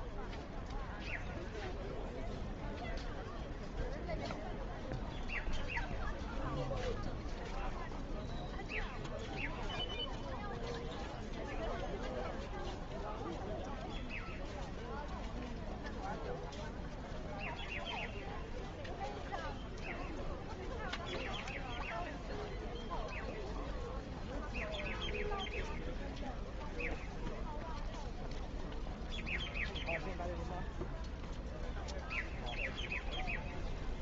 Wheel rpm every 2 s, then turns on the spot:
0, 0, 0, 0, 0, 0, 0, 0, 0, 0, 0, 0, 0, 0, 0, 0, 0.
none